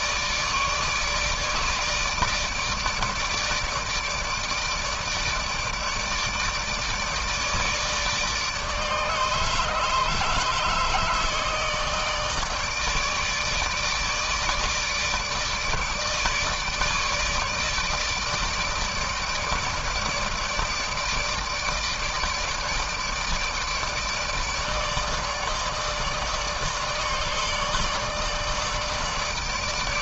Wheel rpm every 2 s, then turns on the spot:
150, 160, 150, 160, 150, 150, 160, 150, 150, 160, 160, 150, 150, 150, 160.
none